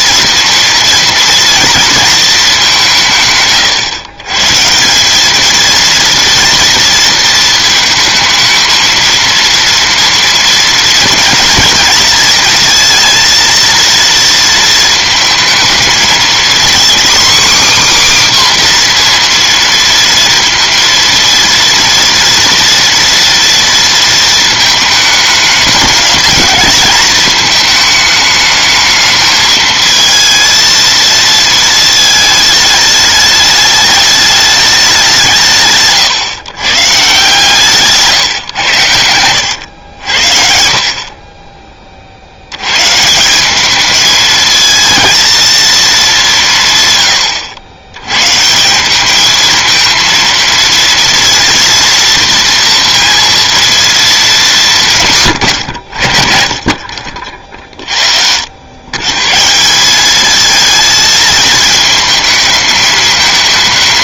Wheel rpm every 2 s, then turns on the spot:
240, 190, 170, 230, 220, 230, 230, 230, 250, 250, 230, 240, 220, 210, 210, 230, 210, 210, 140, 100, 50, 120, 220, 140, 180, 230, 230, 180, 40, 100, 220, 220.
none